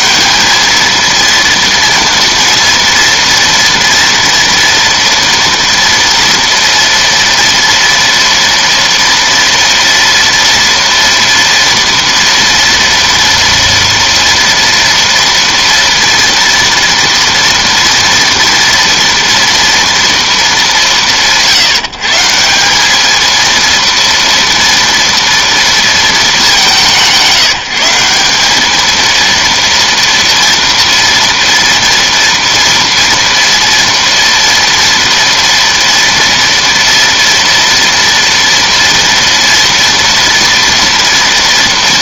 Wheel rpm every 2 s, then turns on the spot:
230, 230, 230, 230, 230, 230, 230, 230, 230, 230, 150, 220, 230, 170, 230, 230, 230, 230, 230, 230, 230.
none